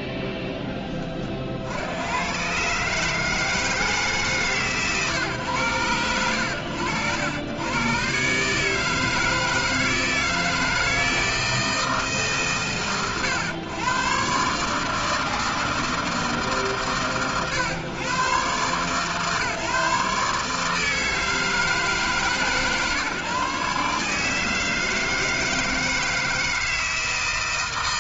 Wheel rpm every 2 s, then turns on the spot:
10, 120, 140, 80, 150, 160, 130, 150, 140, 130, 160, 150, 160, 160.
none